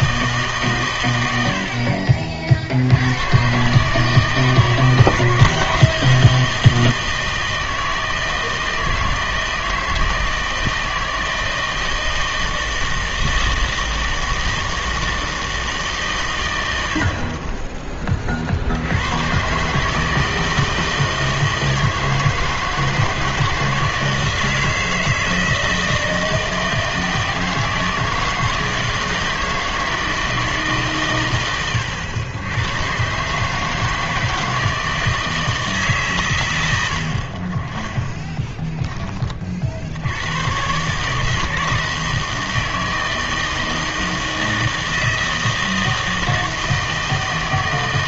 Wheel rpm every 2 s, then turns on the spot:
130, 70, 160, 160, 160, 160, 160, 160, 70, 80, 160, 160, 160, 160, 160, 140, 120, 160, 90, 10, 140, 160, 160, 160.
none